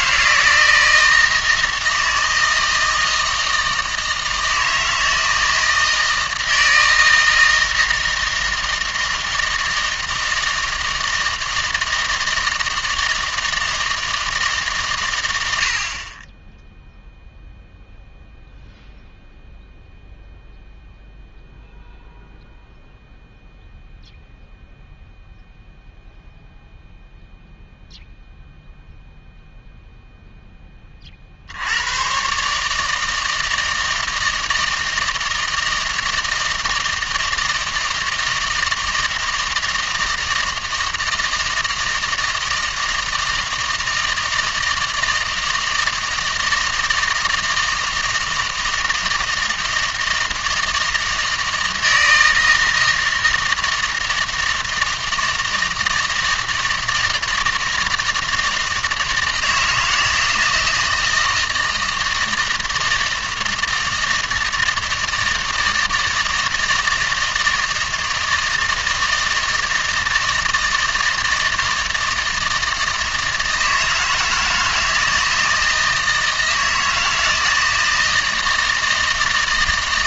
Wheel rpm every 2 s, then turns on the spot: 160, 160, 160, 160, 160, 160, 160, 130, 0, 0, 0, 0, 0, 0, 0, 20, 150, 160, 160, 160, 160, 160, 160, 160, 160, 160, 160, 160, 160, 160, 160, 160, 160, 160, 160, 160, 160, 160, 160, 160.
none